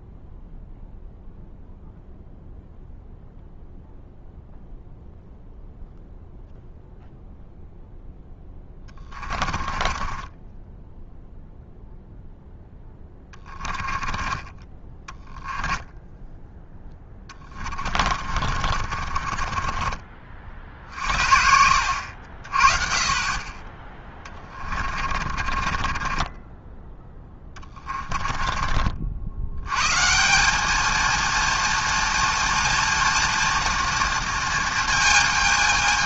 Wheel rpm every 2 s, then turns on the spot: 0, 0, 0, 0, 20, 0, 10, 10, 20, 40, 60, 30, 40, 10, 80, 230, 230, 220.
8-10 12-22 24-28